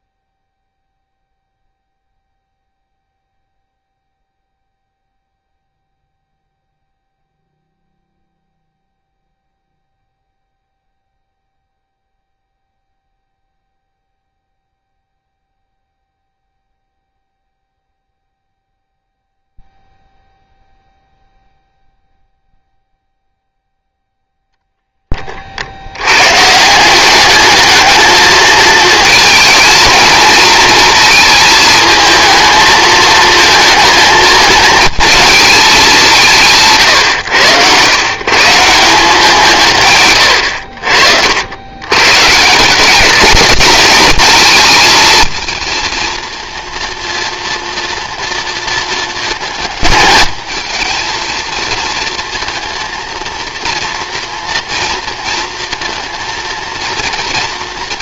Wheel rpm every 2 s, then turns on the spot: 0, 0, 0, 0, 0, 0, 0, 0, 0, 0, 0, 0, 10, 190, 220, 220, 220, 220, 140, 180, 60, 180, 220, 230, 220, 220, 230, 230, 230.
none